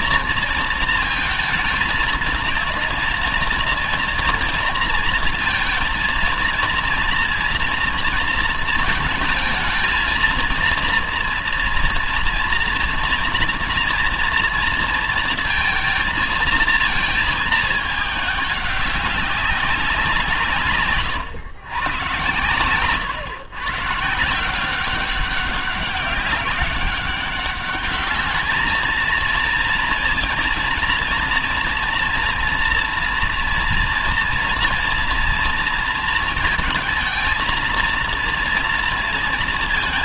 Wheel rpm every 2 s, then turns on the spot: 230, 230, 240, 230, 230, 230, 230, 230, 220, 210, 160, 110, 170, 190, 210, 230, 230, 230, 220, 230.
none